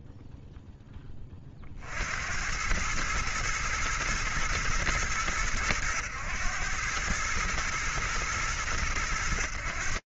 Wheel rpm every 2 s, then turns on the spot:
40, 110, 90, 110, 100.
none